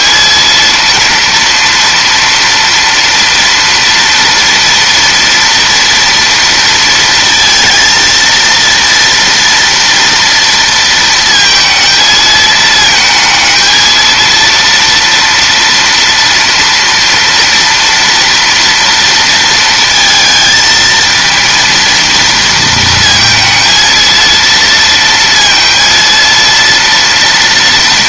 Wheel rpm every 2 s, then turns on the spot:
230, 230, 230, 230, 230, 230, 220, 230, 230, 230, 230, 230, 230, 230.
none